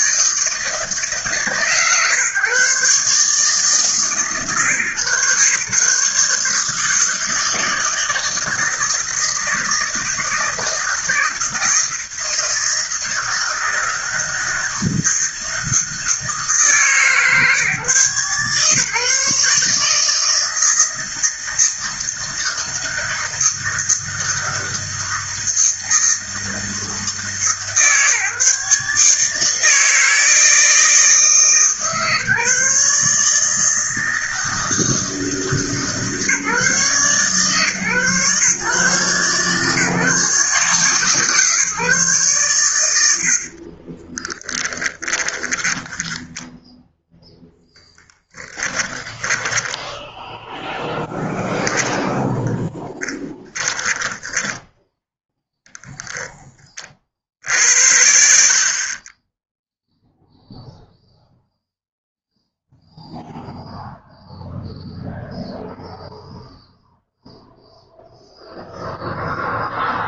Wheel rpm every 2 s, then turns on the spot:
160, 140, 140, 160, 160, 160, 160, 160, 150, 140, 160, 160, 160, 160, 150, 160, 150, 160, 150, 140, 150, 90, 20, 10, 20, 0, 10, 10, 50, 30, 0, 0, 0, 0, 0.
44-46 48-50 52-56